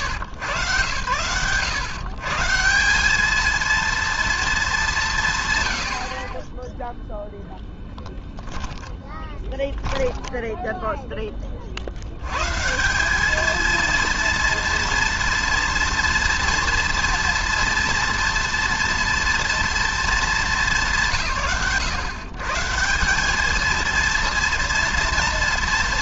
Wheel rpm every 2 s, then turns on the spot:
120, 230, 50, 10, 10, 130, 230, 230, 230, 230, 130, 230, 230.
8-10